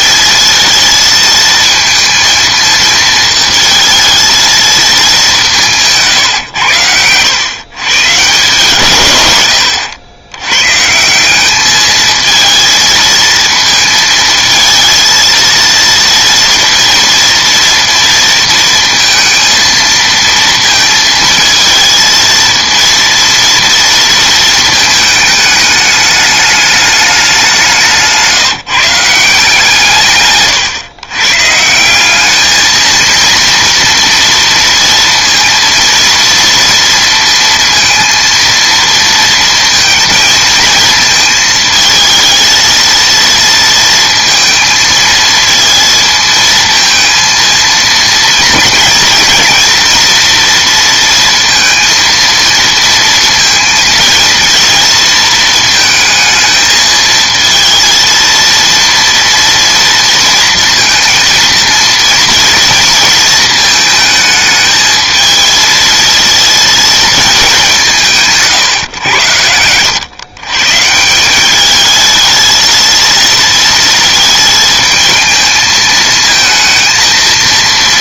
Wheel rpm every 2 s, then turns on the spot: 230, 230, 220, 100, 120, 130, 230, 230, 230, 230, 230, 230, 220, 210, 160, 120, 220, 230, 230, 230, 220, 230, 230, 230, 230, 230, 230, 230, 220, 230, 230, 230, 220, 230, 130, 140, 230, 220, 220.
none